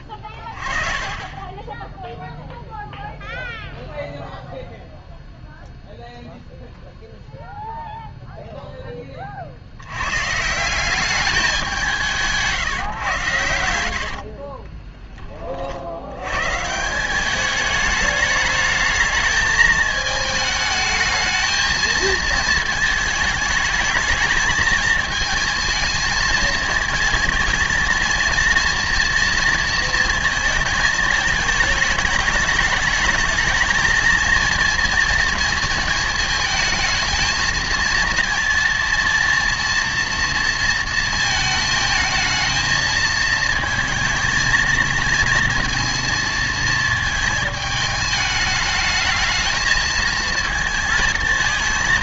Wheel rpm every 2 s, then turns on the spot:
30, 0, 0, 0, 0, 180, 150, 30, 150, 220, 220, 220, 220, 230, 230, 220, 210, 230, 220, 230, 230, 220, 230, 220, 220, 230.
14-16